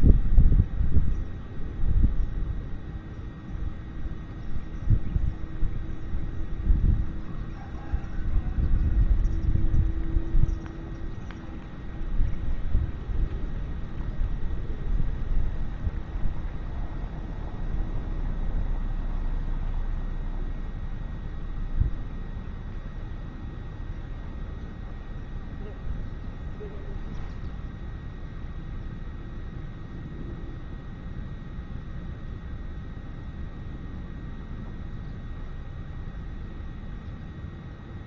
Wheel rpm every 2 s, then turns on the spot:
0, 0, 0, 0, 0, 0, 0, 0, 0, 0, 0, 0, 0, 0, 0, 0, 0, 0, 0.
none